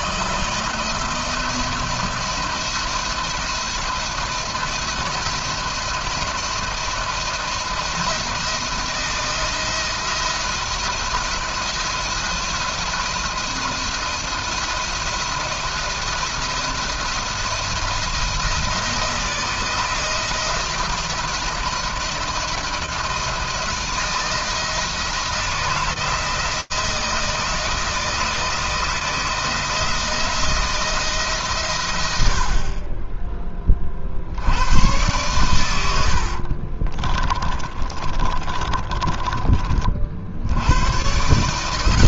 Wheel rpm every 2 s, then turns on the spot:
170, 170, 170, 170, 170, 170, 170, 160, 170, 160, 170, 170, 160, 170, 160, 160, 30, 110, 30, 30, 120.
36-40